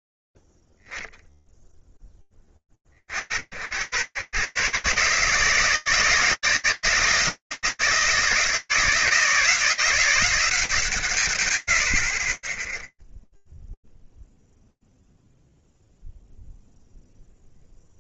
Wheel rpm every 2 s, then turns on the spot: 0, 30, 130, 160, 160, 160, 10, 0, 0.
none